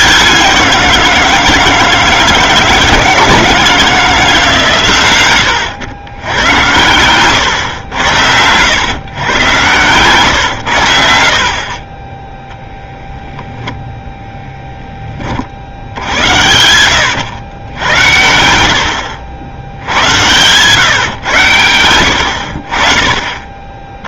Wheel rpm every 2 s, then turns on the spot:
180, 160, 140, 110, 110, 100, 10, 10, 100, 80, 130, 60.
none